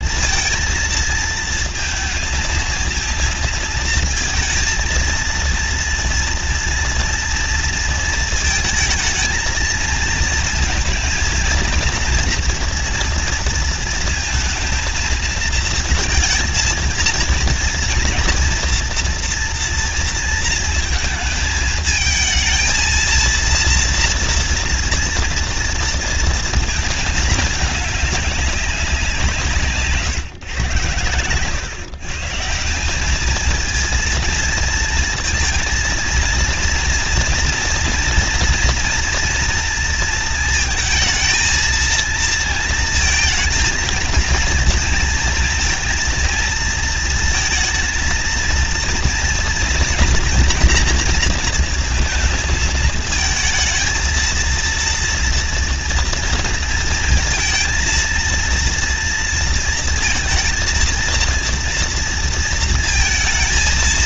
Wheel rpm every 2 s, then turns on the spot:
230, 220, 230, 230, 220, 220, 230, 230, 230, 240, 230, 220, 230, 220, 190, 110, 180, 230, 230, 230, 220, 230, 230, 230, 230, 230, 220, 230, 230, 230, 230, 230.
none